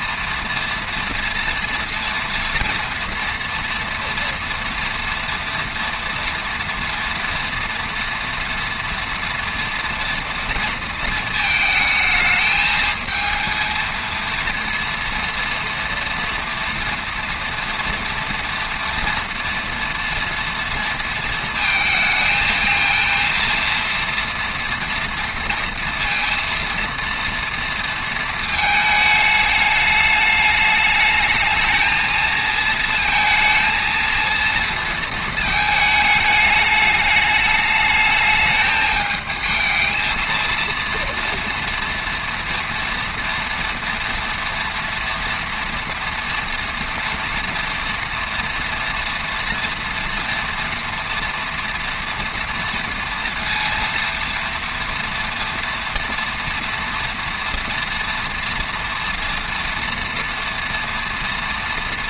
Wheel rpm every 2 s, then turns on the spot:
230, 230, 230, 230, 230, 230, 220, 230, 230, 240, 230, 220, 230, 230, 220, 210, 230, 230, 210, 210, 230, 230, 240, 230, 230, 230, 230, 230, 230, 230, 230.
none